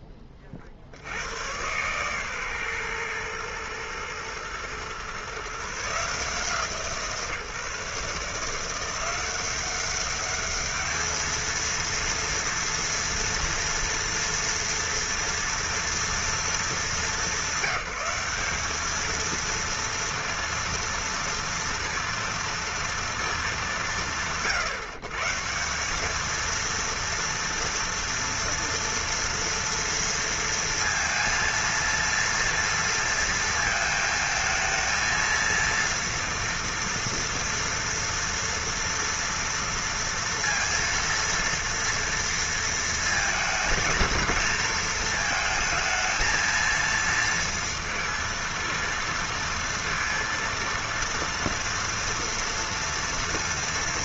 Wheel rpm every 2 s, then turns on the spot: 40, 130, 120, 160, 160, 210, 230, 230, 220, 200, 230, 230, 120, 230, 230, 230, 230, 220, 230, 230, 230, 230, 230, 230, 230, 230, 240.
none